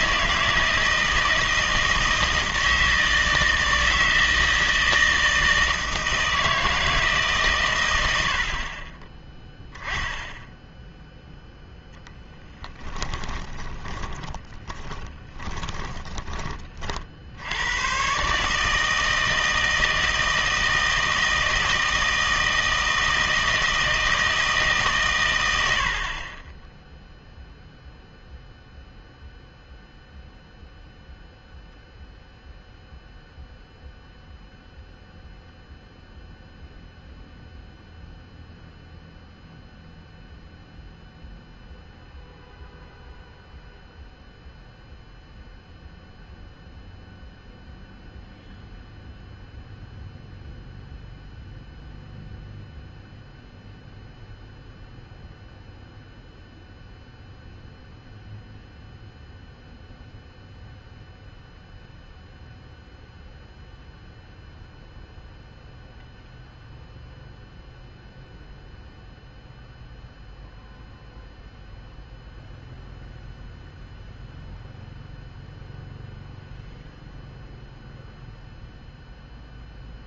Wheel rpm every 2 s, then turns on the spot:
160, 160, 160, 160, 50, 10, 10, 20, 40, 150, 160, 160, 150, 10, 0, 0, 0, 0, 0, 0, 0, 0, 0, 0, 0, 0, 0, 0, 0, 0, 0, 0, 0, 0, 0, 0, 0, 0, 0, 0.
12-16